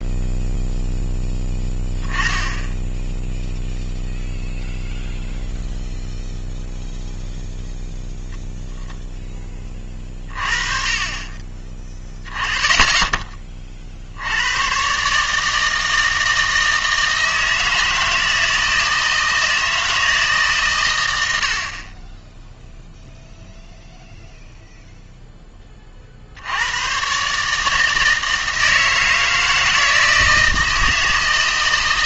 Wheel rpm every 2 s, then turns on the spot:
0, 10, 0, 0, 0, 30, 10, 120, 160, 160, 130, 0, 0, 100, 160, 160.
none